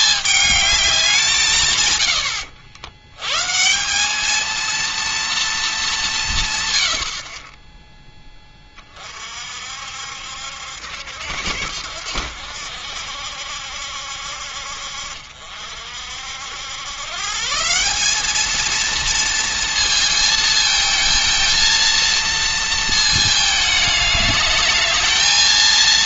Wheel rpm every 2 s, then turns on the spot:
200, 90, 230, 100, 30, 80, 80, 60, 90, 220, 220, 230, 210.
none